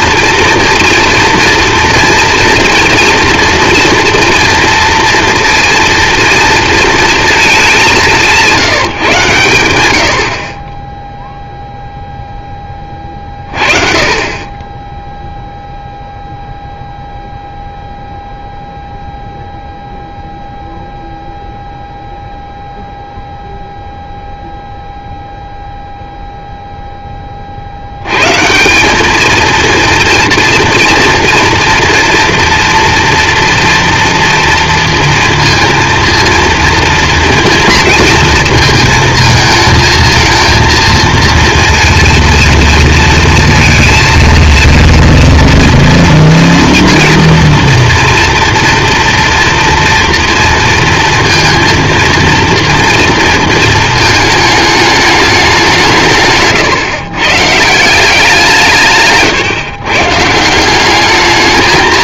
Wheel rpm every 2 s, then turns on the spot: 230, 230, 230, 230, 170, 40, 10, 20, 0, 0, 0, 0, 0, 0, 150, 230, 230, 230, 230, 230, 230, 230, 230, 230, 230, 230, 230, 220, 130, 170, 170.
none